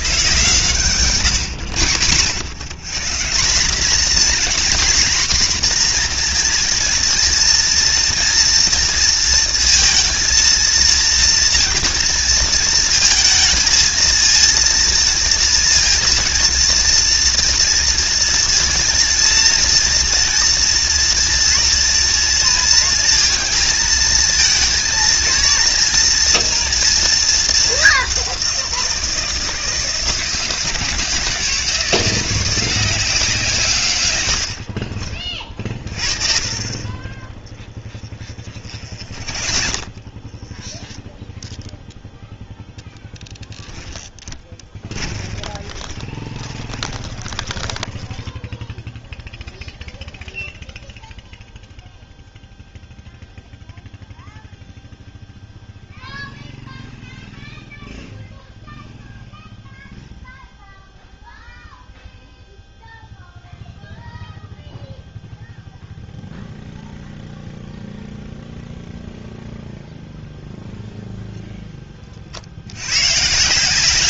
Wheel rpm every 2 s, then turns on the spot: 130, 150, 260, 230, 230, 230, 220, 230, 230, 230, 230, 230, 230, 230, 170, 170, 180, 50, 30, 40, 10, 10, 20, 20, 0, 0, 0, 0, 0, 0, 0, 0, 0, 0, 0, 0, 100.
36-40 44-48